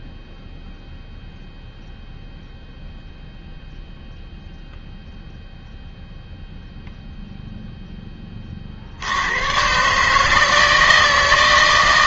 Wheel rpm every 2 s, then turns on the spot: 0, 0, 0, 0, 50, 160.
none